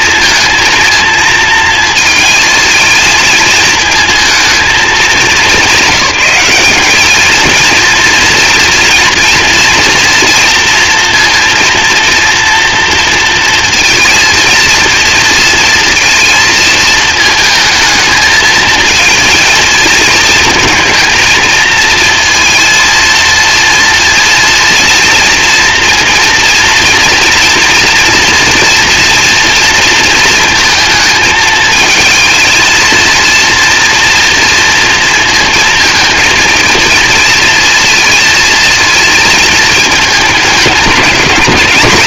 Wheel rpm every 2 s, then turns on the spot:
230, 220, 220, 200, 230, 230, 230, 230, 230, 220, 230, 230, 230, 230, 230, 220, 220, 230, 230, 230, 200.
none